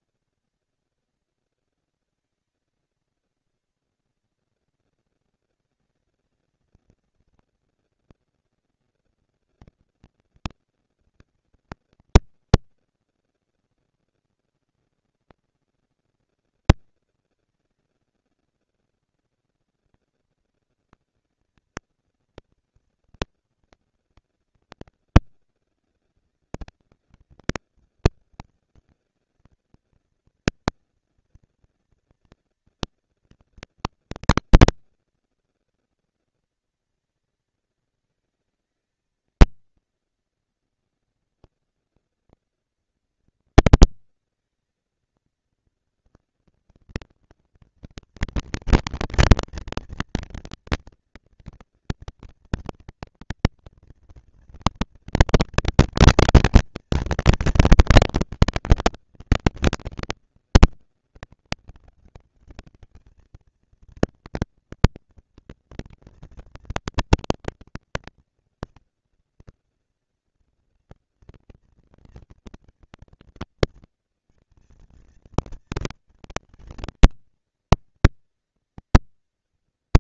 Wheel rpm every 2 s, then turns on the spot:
230, 230, 230, 220, 230, 230, 230, 230, 230, 230, 230, 220, 200, 200, 210, 230, 230, 230, 230, 220, 230, 240, 230, 230, 230, 230, 230, 230, 230, 210, 200, 200, 230, 230, 230, 230, 230, 230, 220, 230.
none